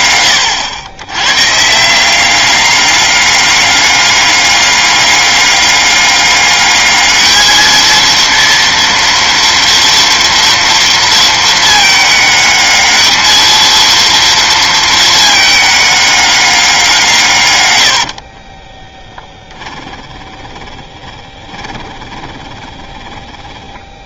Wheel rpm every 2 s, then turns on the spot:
110, 200, 200, 220, 230, 230, 220, 220, 150, 10, 20, 10.
18-24